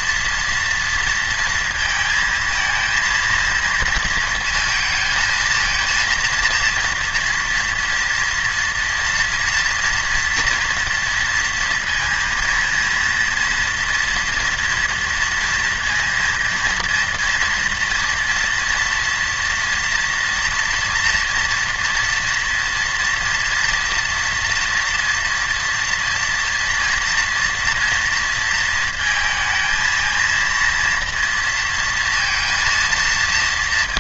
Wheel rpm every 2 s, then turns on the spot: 230, 220, 230, 230, 230, 230, 230, 230, 230, 230, 230, 230, 230, 230, 230, 230, 230.
none